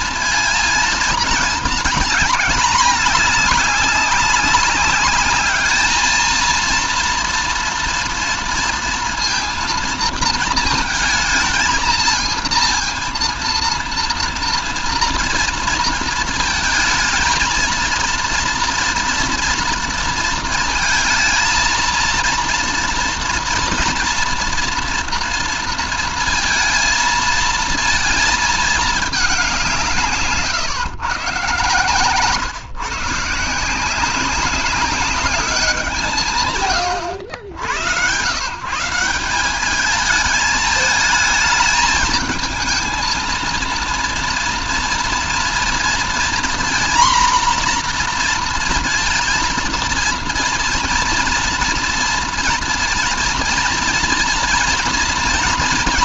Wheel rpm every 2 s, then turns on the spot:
220, 200, 200, 230, 230, 220, 230, 230, 220, 230, 220, 240, 230, 230, 210, 140, 150, 200, 110, 170, 220, 220, 230, 240, 230, 230, 230, 230.
none